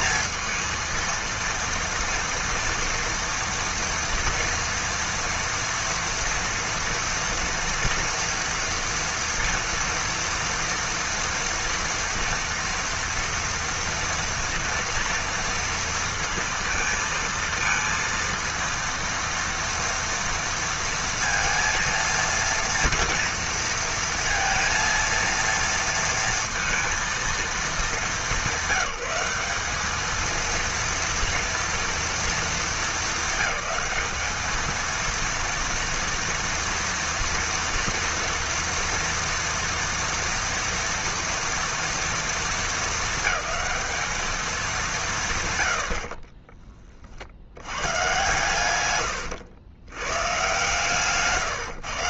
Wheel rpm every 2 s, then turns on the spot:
230, 230, 230, 240, 230, 230, 230, 230, 230, 230, 230, 230, 230, 230, 200, 230, 220, 220, 230, 230, 230, 230, 210, 20, 130, 130.
none